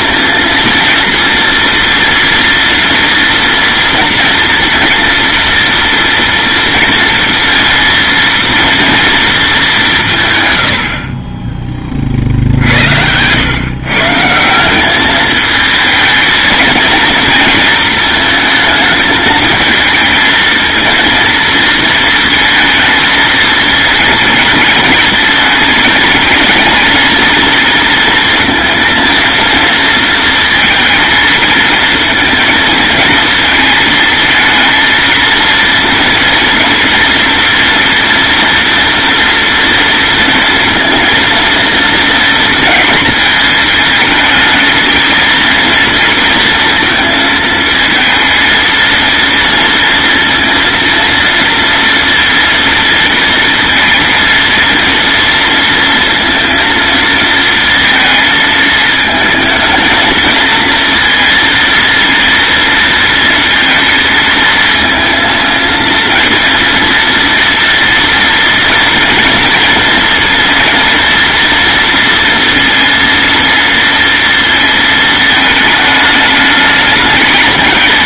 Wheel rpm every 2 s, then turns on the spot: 230, 230, 230, 230, 230, 70, 80, 200, 220, 220, 230, 230, 210, 220, 230, 220, 220, 230, 230, 230, 230, 230, 220, 230, 230, 230, 230, 230, 230, 220, 230, 230, 220, 230, 230, 230, 230, 220, 210.
none